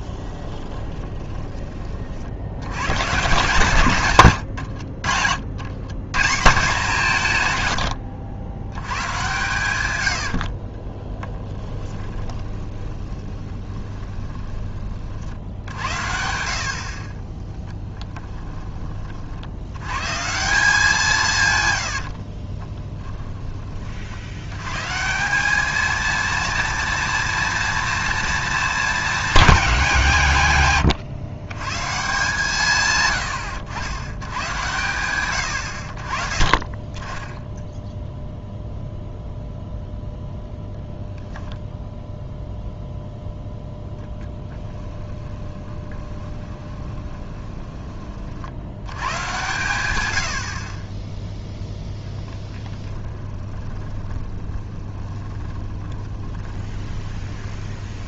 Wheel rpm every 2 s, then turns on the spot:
30, 110, 70, 170, 120, 30, 20, 30, 50, 30, 170, 20, 140, 230, 220, 120, 130, 110, 20, 0, 0, 0, 20, 20, 110, 30, 20, 10, 10.
0-2 4-6 8-14 22-24 44-48 52-58